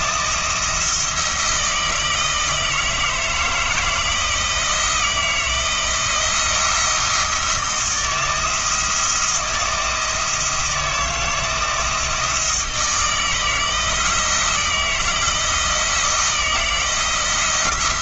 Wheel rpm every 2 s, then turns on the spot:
170, 160, 170, 170, 170, 170, 160, 170, 170.
none